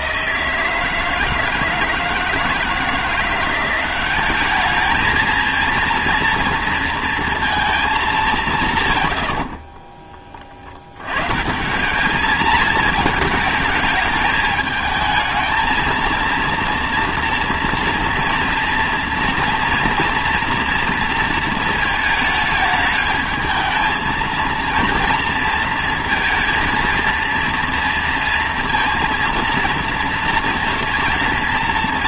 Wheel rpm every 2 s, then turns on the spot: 160, 160, 210, 230, 150, 50, 220, 220, 230, 230, 230, 220, 230, 230, 230, 230.
none